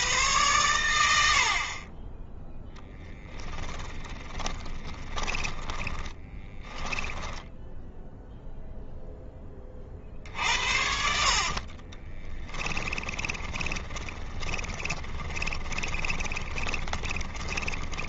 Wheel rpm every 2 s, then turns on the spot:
90, 10, 10, 10, 0, 70, 20, 20, 20.
4-8 10-18